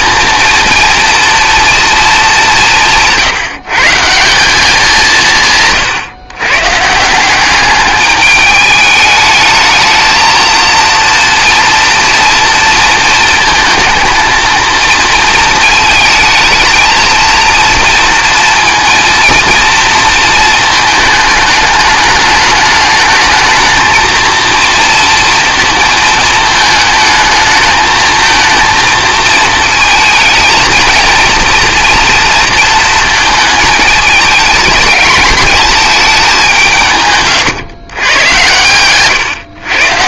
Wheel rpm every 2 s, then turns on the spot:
230, 180, 180, 150, 210, 230, 230, 230, 220, 230, 220, 210, 230, 220, 220, 220, 230, 220, 180, 120.
38-40